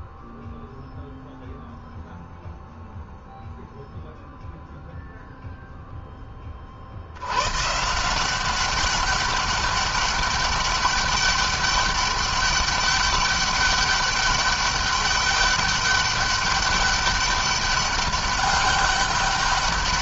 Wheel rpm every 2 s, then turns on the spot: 0, 0, 0, 50, 200, 200, 200, 200, 200, 200.
none